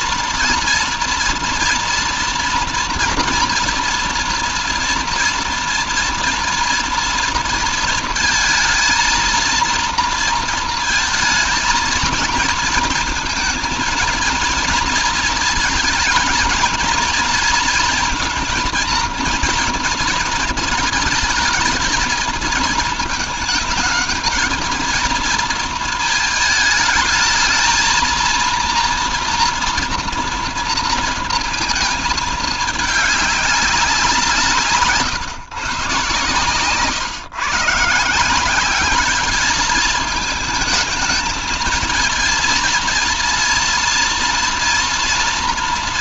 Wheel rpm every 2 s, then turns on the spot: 230, 230, 230, 230, 230, 230, 220, 230, 230, 230, 220, 220, 220, 220, 230, 230, 210, 140, 140, 190, 220, 230, 230.
none